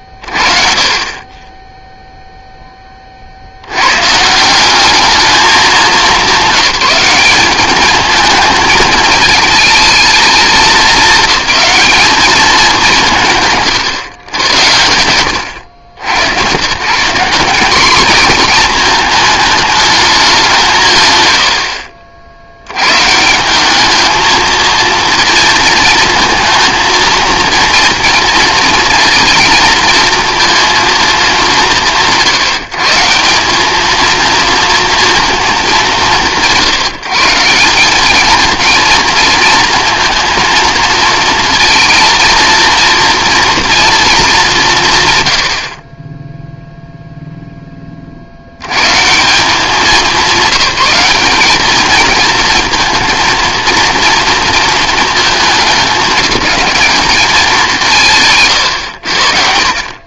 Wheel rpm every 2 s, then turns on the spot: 20, 10, 190, 200, 220, 220, 200, 90, 160, 220, 170, 100, 230, 230, 220, 220, 160, 230, 140, 230, 230, 230, 140, 0, 90, 190, 230, 230, 210, 140.
none